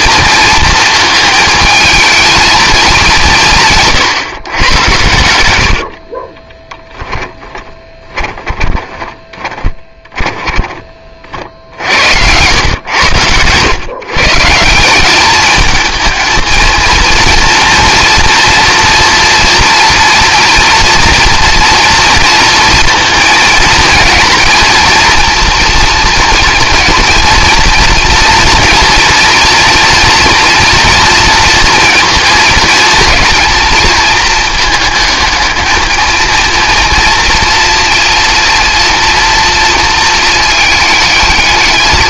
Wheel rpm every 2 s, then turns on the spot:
230, 210, 110, 20, 10, 30, 100, 180, 220, 230, 230, 230, 230, 230, 230, 230, 230, 220, 230, 230, 220.
6-10